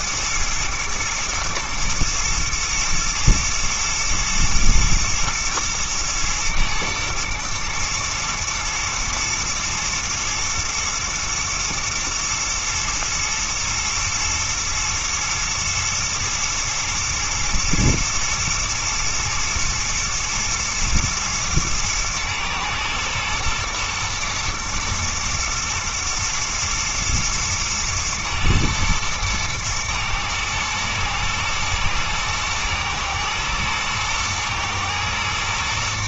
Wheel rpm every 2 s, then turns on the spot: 120, 110, 120, 120, 110, 120, 110, 110, 110, 110, 110, 110, 110, 110, 110, 110, 110, 110.
none